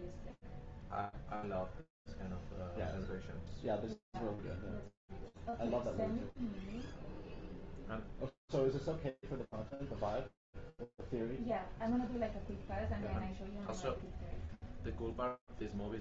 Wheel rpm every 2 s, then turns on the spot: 0, 0, 0, 0, 0, 0, 0, 0.
none